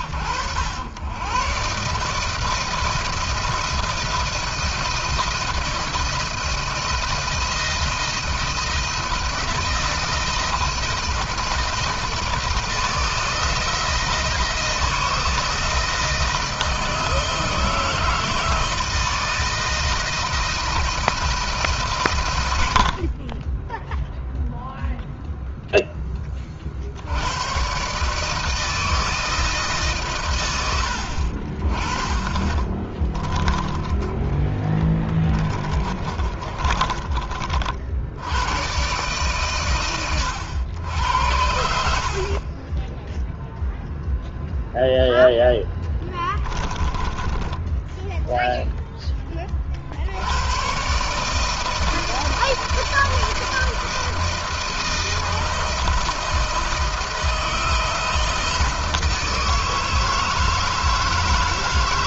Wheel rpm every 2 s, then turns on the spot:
100, 160, 170, 170, 160, 160, 160, 160, 160, 160, 160, 50, 0, 80, 160, 70, 20, 20, 40, 130, 90, 10, 0, 10, 10, 130, 160, 160, 160, 160, 160.
32-38 46-48